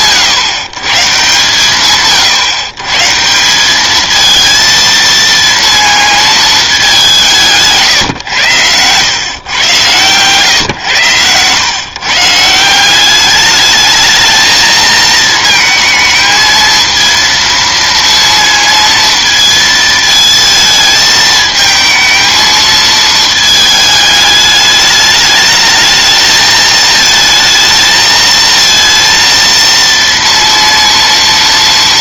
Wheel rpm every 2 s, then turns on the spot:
130, 140, 230, 220, 100, 120, 170, 220, 220, 230, 220, 220, 210, 220, 230, 230.
8-10